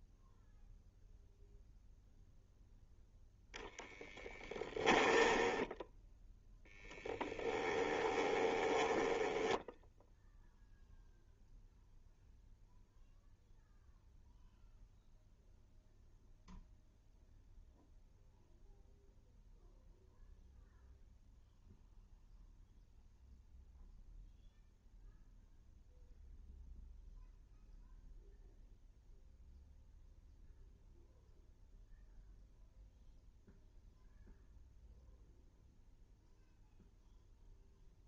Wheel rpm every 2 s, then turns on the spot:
0, 0, 10, 0, 10, 0, 0, 0, 0, 0, 0, 0, 0, 0, 0, 0, 0, 0, 0.
4-6 8-10